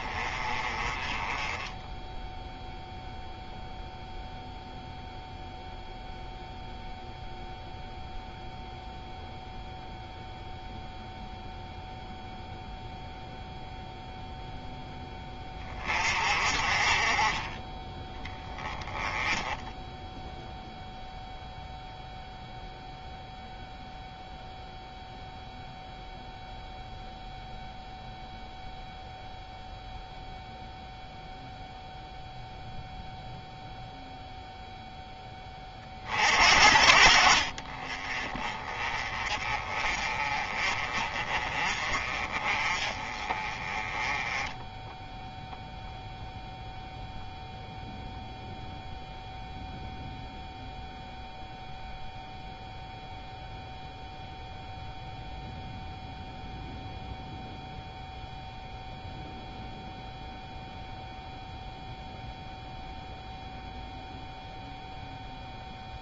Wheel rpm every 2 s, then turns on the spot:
20, 0, 0, 0, 0, 0, 0, 10, 30, 10, 0, 0, 0, 0, 0, 0, 0, 0, 50, 20, 30, 30, 10, 0, 0, 0, 0, 0, 0, 0, 0, 0, 0.
none